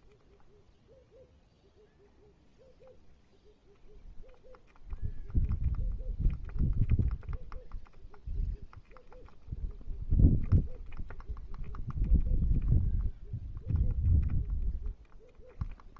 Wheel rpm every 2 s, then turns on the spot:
0, 0, 0, 0, 0, 0, 0, 0.
none